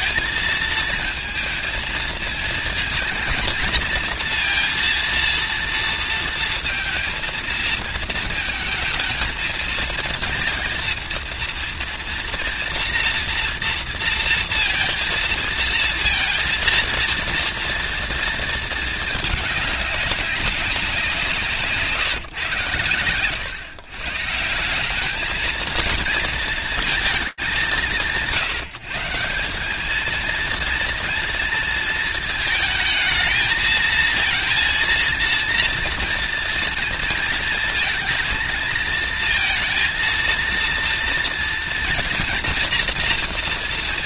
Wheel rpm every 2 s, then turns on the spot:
220, 220, 230, 230, 220, 230, 230, 230, 230, 230, 190, 130, 150, 230, 160, 230, 220, 230, 230, 230, 230, 230.
none